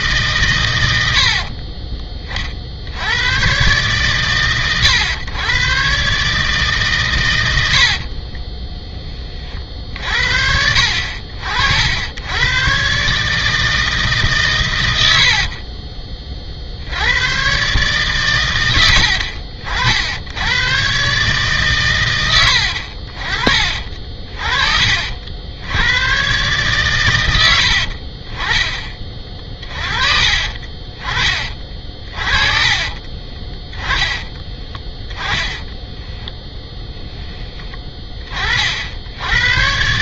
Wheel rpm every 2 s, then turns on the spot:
110, 70, 110, 140, 20, 70, 130, 100, 60, 90, 120, 70, 40, 130, 20, 30, 30, 20, 20, 70.
32-36